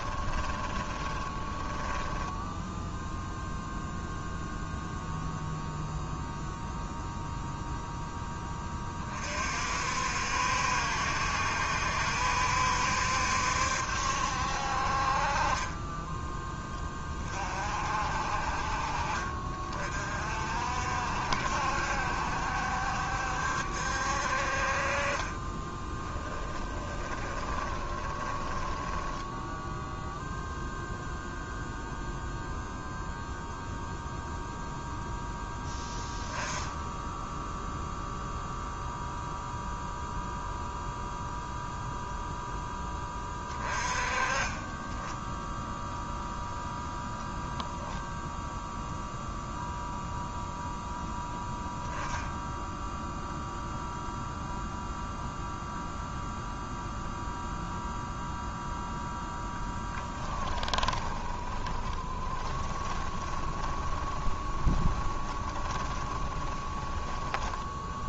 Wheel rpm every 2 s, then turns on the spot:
20, 0, 0, 0, 30, 70, 70, 50, 20, 50, 60, 70, 40, 30, 20, 0, 0, 0, 10, 0, 0, 0, 10, 0, 0, 0, 0, 0, 0, 0, 20, 20, 20, 20.
0-2 26-30 60-68